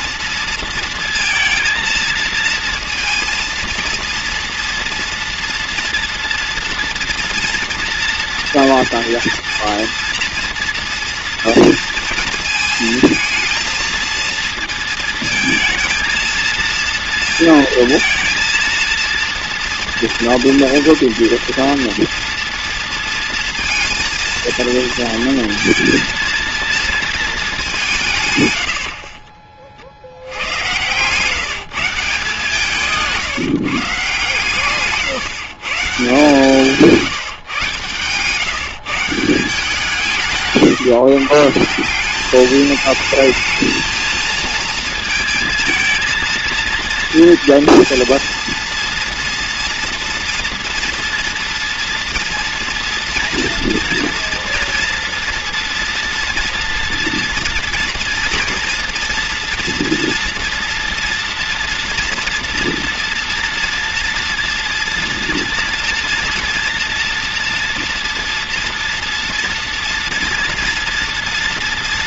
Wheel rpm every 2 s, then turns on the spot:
230, 230, 230, 240, 230, 230, 230, 230, 230, 230, 230, 230, 220, 220, 80, 130, 170, 130, 160, 160, 140, 220, 230, 230, 230, 230, 230, 230, 240, 230, 230, 230, 240, 230, 230, 230.
36-38